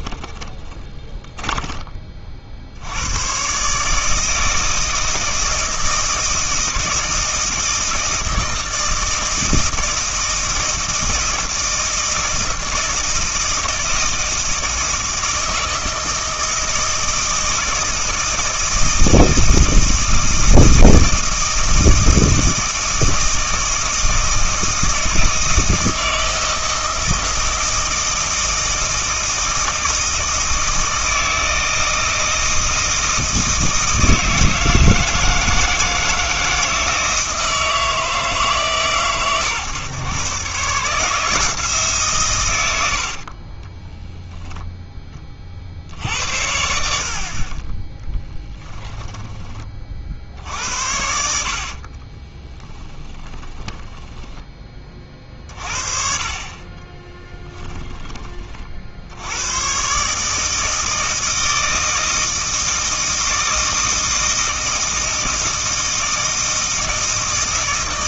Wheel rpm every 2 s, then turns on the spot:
20, 80, 160, 160, 160, 160, 160, 160, 160, 160, 160, 160, 160, 160, 160, 160, 160, 160, 160, 140, 150, 80, 10, 70, 10, 80, 10, 20, 30, 50, 160, 160, 160, 160.
0-2 42-44 48-50 52-54 56-58